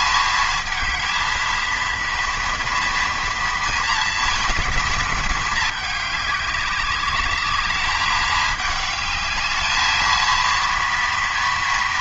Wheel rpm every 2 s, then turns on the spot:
220, 230, 220, 200, 210, 230.
none